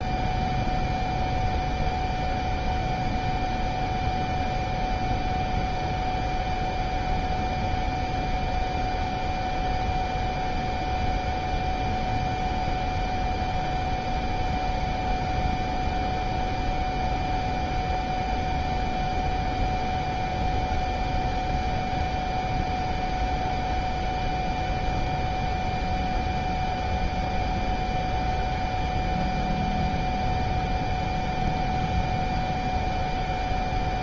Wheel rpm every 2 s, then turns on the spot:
0, 0, 0, 0, 0, 0, 0, 0, 0, 0, 0, 0, 0, 0, 0, 0, 0.
none